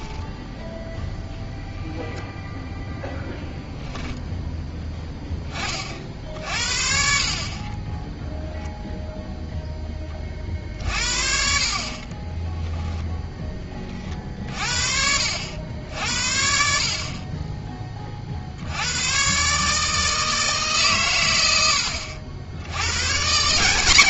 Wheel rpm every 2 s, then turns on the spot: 0, 10, 10, 60, 0, 50, 10, 40, 60, 80, 150, 90.
12-14